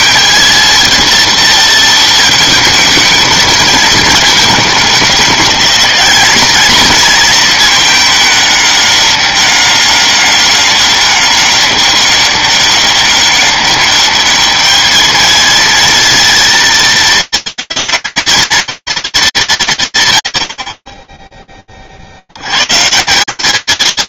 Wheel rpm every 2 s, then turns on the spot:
230, 220, 210, 220, 200, 200, 200, 210, 230, 230, 130, 70.
none